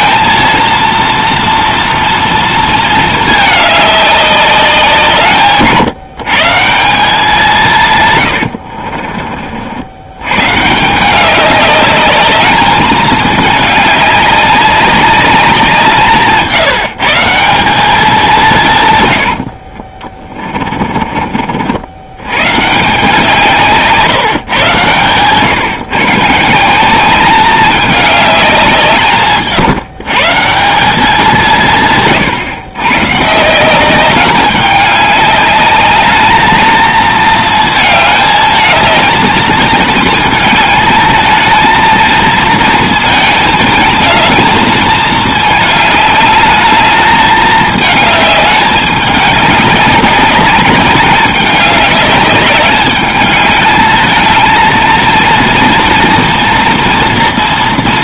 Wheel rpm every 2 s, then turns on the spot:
230, 230, 180, 170, 70, 160, 210, 200, 150, 140, 30, 140, 130, 160, 190, 180, 130, 200, 220, 210, 220, 220, 220, 210, 210, 200, 210, 230, 240.
8-10 20-22